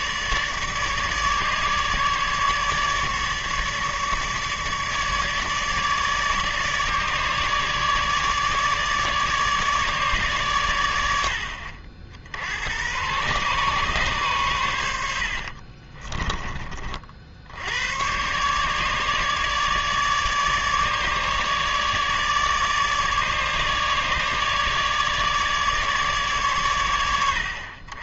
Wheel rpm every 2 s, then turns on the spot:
150, 150, 150, 150, 150, 100, 100, 90, 40, 150, 150, 150, 150, 100.
none